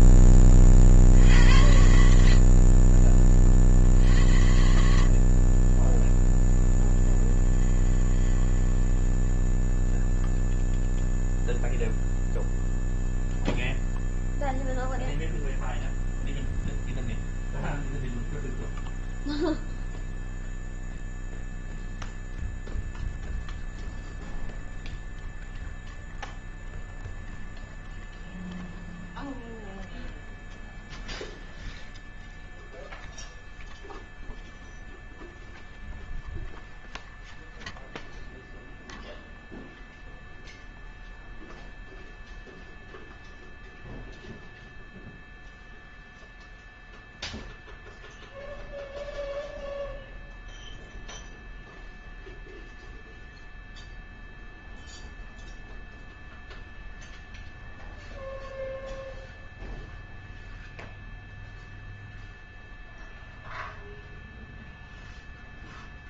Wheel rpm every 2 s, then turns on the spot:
50, 30, 60, 10, 10, 0, 0, 0, 0, 0, 0, 0, 0, 0, 0, 0, 0, 0, 0, 0, 0, 0, 0, 0, 0, 0, 0, 0, 0, 0, 0, 0, 0.
6-10